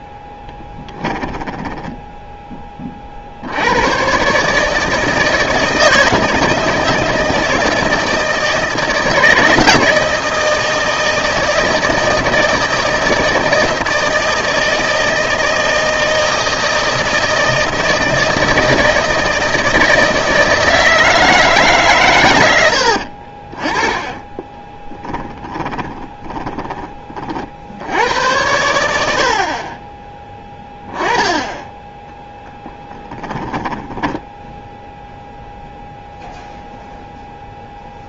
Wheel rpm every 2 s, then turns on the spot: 10, 20, 150, 160, 160, 160, 160, 160, 160, 160, 170, 90, 10, 30, 90, 10, 10, 0, 0.
0-2 22-28 32-34